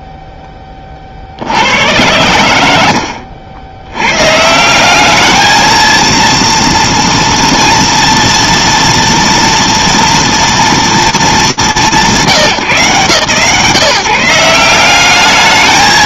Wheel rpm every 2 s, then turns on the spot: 50, 90, 220, 230, 230, 190, 160, 200.
none